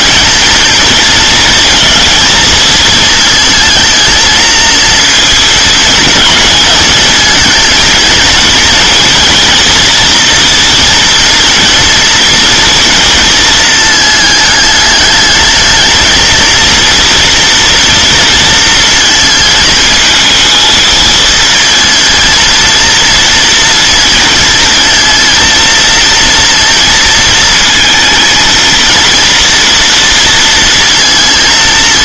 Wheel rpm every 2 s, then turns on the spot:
220, 220, 230, 220, 230, 240, 220, 210, 230, 230, 230, 230, 230, 230, 230, 230.
none